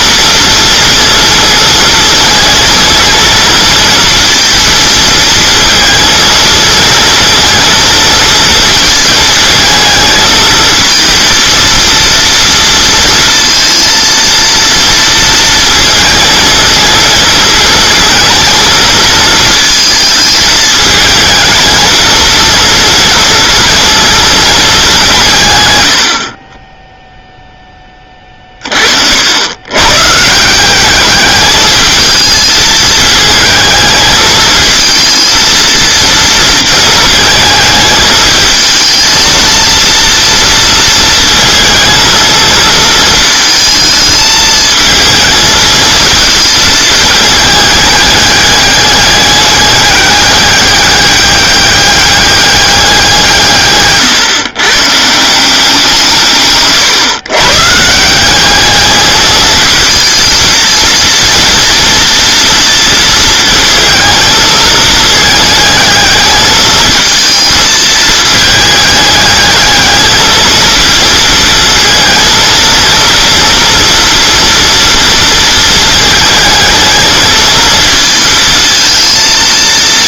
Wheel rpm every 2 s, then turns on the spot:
230, 230, 230, 230, 230, 230, 230, 230, 230, 230, 220, 230, 200, 10, 40, 190, 220, 220, 230, 220, 230, 230, 220, 220, 210, 200, 190, 130, 140, 210, 230, 230, 220, 220, 210, 220, 230, 230, 220, 220.
56-58